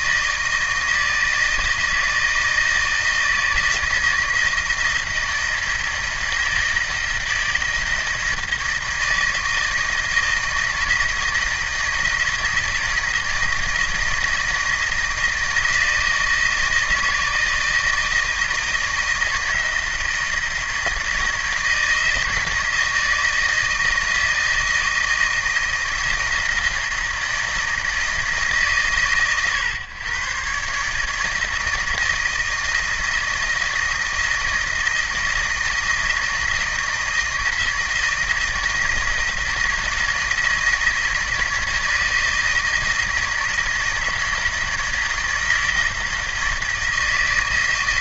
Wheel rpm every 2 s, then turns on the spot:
160, 160, 160, 160, 160, 160, 160, 160, 160, 160, 160, 160, 160, 160, 130, 140, 160, 160, 160, 160, 160, 160, 160, 160.
none